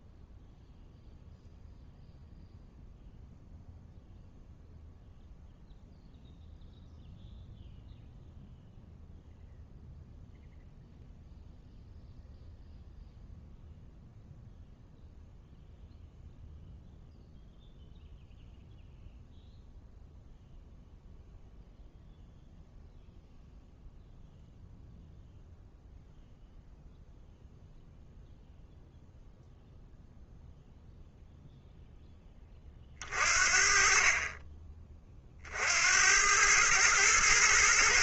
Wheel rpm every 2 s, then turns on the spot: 0, 0, 0, 0, 0, 0, 0, 0, 0, 0, 0, 0, 0, 0, 0, 0, 30, 30, 110.
none